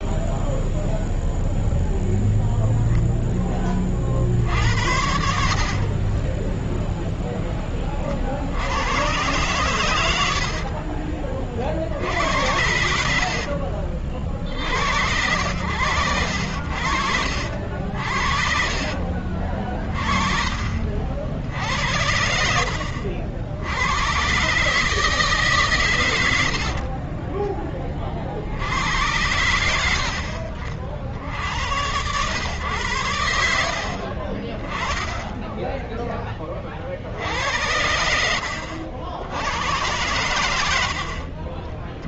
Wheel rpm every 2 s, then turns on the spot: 0, 0, 50, 10, 60, 90, 80, 50, 80, 60, 40, 80, 130, 80, 70, 70, 110, 30, 40, 70, 90.
6-8 20-22